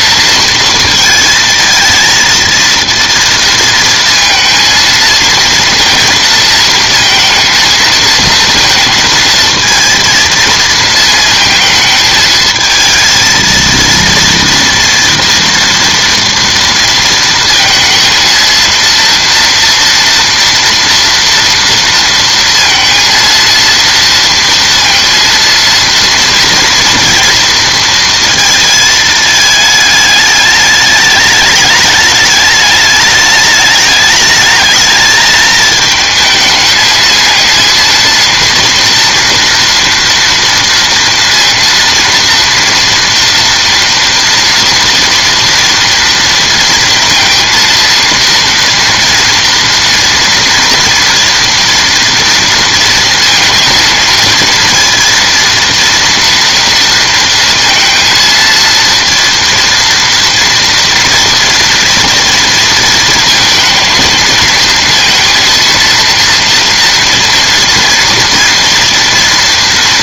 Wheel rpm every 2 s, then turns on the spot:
230, 230, 230, 230, 230, 220, 220, 230, 230, 230, 230, 230, 230, 230, 220, 210, 210, 210, 220, 230, 230, 230, 230, 230, 230, 230, 230, 230, 230, 230, 230, 230, 230, 240, 230.
none